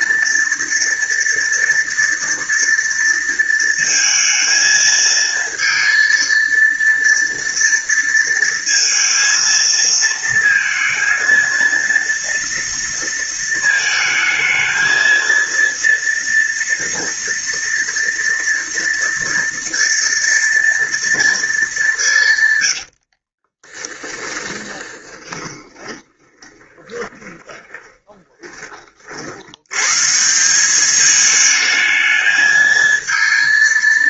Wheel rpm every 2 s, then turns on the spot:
230, 230, 230, 230, 230, 230, 230, 230, 230, 230, 230, 50, 10, 20, 50, 210, 220.
22-28